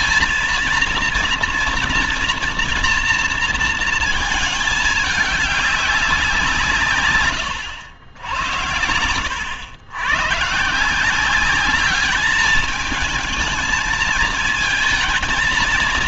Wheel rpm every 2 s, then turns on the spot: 230, 230, 210, 150, 90, 150, 210, 220.
none